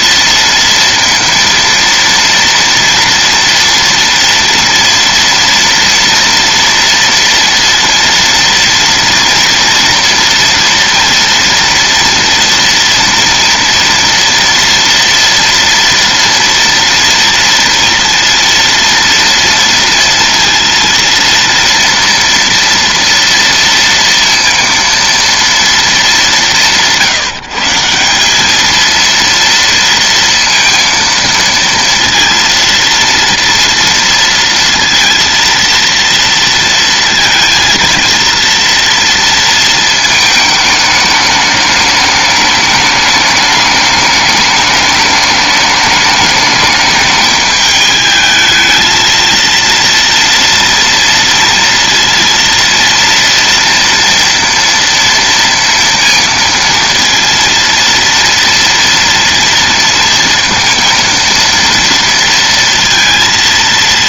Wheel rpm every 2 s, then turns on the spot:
230, 230, 230, 230, 230, 230, 230, 230, 230, 230, 230, 230, 230, 170, 230, 230, 230, 230, 230, 230, 210, 210, 210, 210, 230, 230, 230, 230, 230, 230, 230, 230.
none